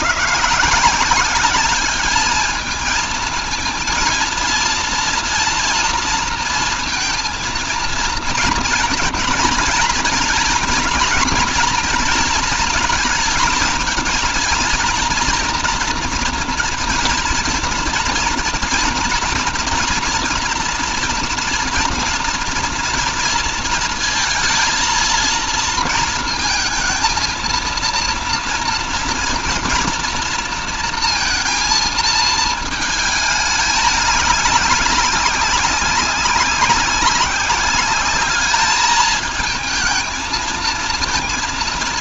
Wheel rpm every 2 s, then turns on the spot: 170, 220, 230, 230, 230, 230, 230, 230, 230, 230, 240, 240, 230, 220, 230, 230, 220, 200, 190, 210, 220.
none